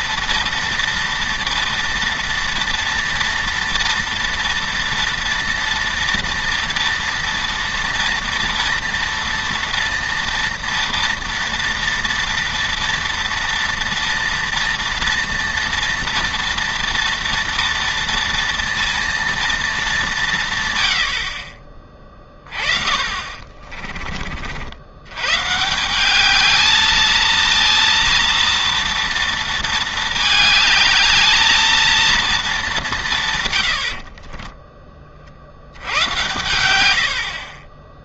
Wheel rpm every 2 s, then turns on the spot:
230, 230, 230, 230, 240, 230, 230, 230, 230, 230, 140, 30, 70, 220, 230, 210, 220, 20, 100.
none